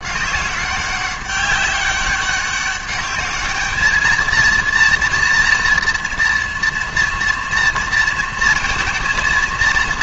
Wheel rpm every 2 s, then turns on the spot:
190, 200, 230, 230, 230.
none